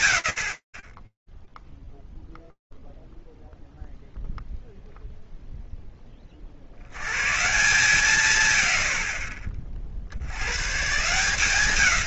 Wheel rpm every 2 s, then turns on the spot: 70, 0, 0, 60, 130, 120.
none